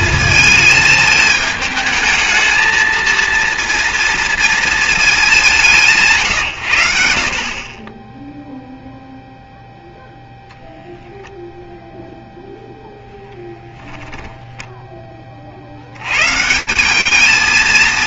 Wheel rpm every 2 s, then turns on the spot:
210, 230, 190, 70, 0, 0, 10, 40, 220.
none